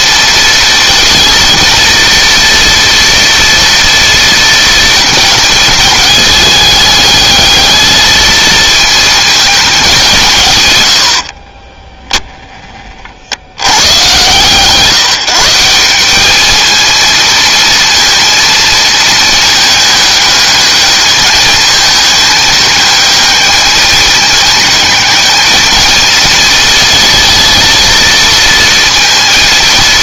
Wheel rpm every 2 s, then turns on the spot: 230, 230, 220, 210, 220, 120, 20, 150, 220, 230, 210, 220, 220, 230, 230.
none